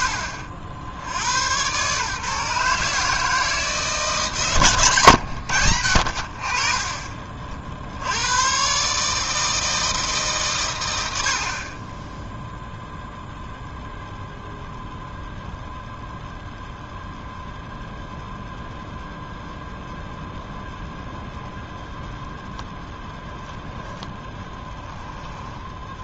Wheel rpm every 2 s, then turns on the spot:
60, 150, 140, 30, 140, 90, 0, 0, 0, 0, 0, 0, 10.
4-6